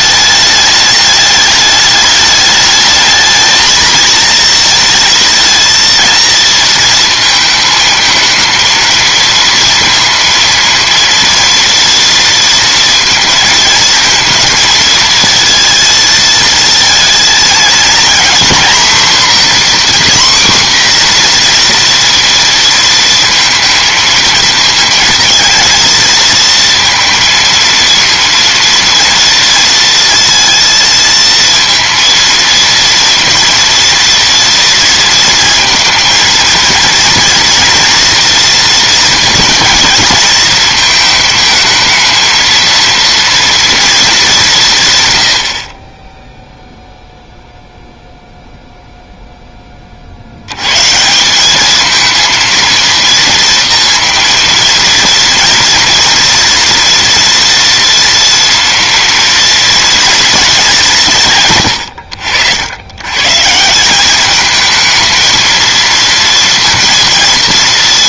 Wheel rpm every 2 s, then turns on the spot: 210, 210, 230, 220, 220, 230, 230, 230, 230, 240, 250, 230, 220, 230, 230, 230, 230, 230, 230, 230, 220, 230, 150, 0, 0, 130, 230, 230, 230, 230, 190, 90, 220, 230.
none